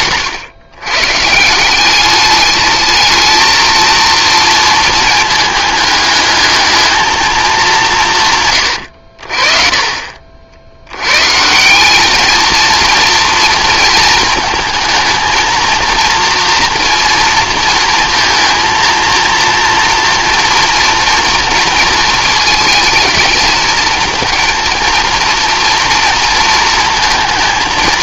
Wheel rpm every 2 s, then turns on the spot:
130, 210, 230, 220, 90, 90, 230, 220, 240, 230, 230, 220, 230, 220.
none